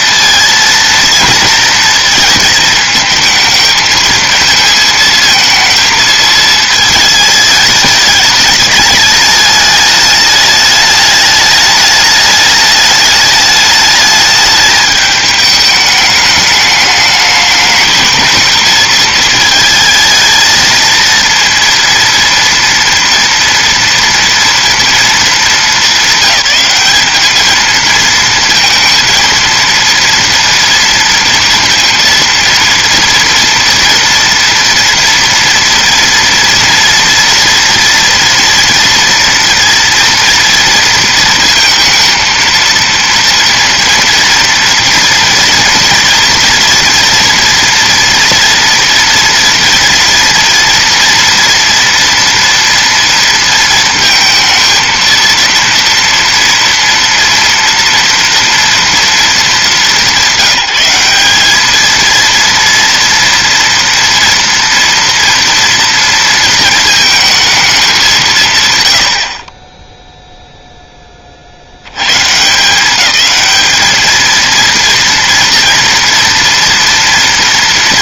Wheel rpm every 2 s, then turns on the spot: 230, 220, 220, 220, 210, 210, 210, 210, 210, 220, 230, 230, 230, 190, 230, 230, 230, 230, 230, 230, 230, 230, 230, 240, 230, 230, 230, 230, 230, 240, 180, 230, 230, 230, 130, 10, 200, 230, 230.
none